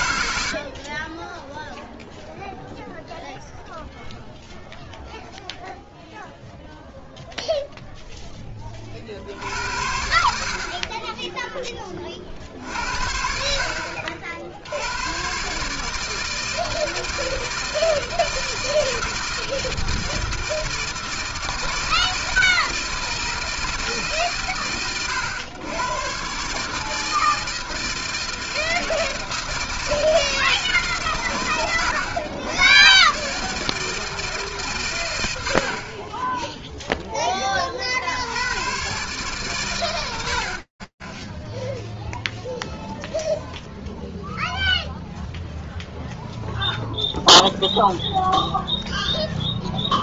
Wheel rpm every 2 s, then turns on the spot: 0, 0, 0, 0, 80, 10, 60, 140, 160, 160, 160, 160, 110, 160, 160, 110, 150, 70, 20, 110, 0, 0, 0, 0, 0.
none